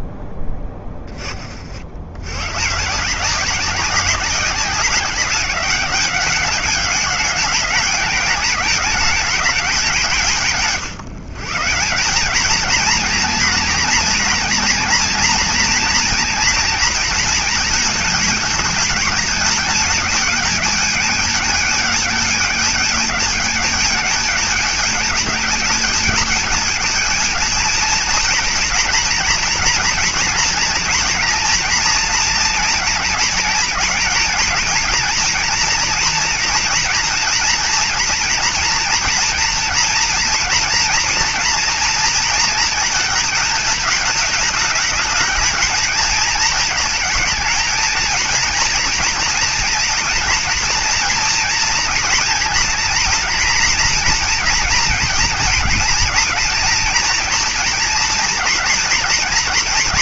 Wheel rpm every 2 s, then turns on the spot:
10, 140, 180, 200, 210, 150, 230, 230, 230, 220, 210, 210, 220, 220, 240, 230, 220, 230, 230, 240, 240, 230, 220, 220, 230, 230, 230, 230, 220, 230.
none